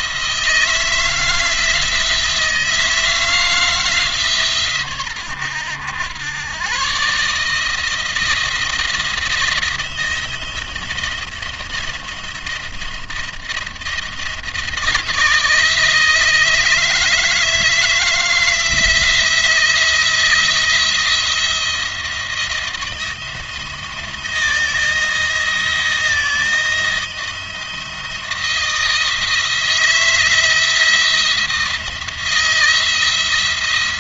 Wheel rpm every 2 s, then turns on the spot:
160, 160, 120, 130, 170, 170, 170, 160, 160, 170, 170, 170, 170, 170, 170, 170, 170.
none